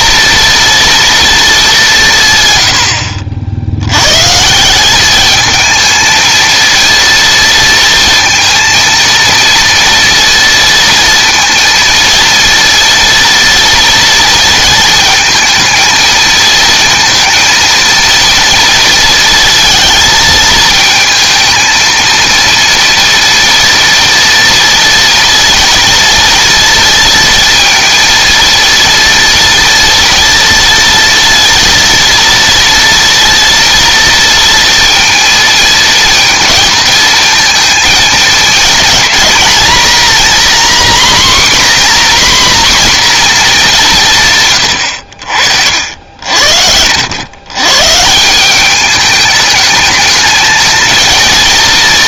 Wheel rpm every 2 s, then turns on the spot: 230, 100, 170, 230, 230, 230, 230, 230, 230, 230, 230, 230, 230, 230, 230, 230, 230, 230, 220, 220, 260, 250, 130, 80, 190, 220.
44-46